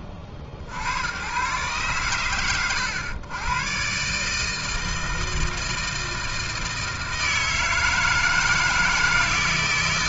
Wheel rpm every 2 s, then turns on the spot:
80, 90, 160, 160, 160.
none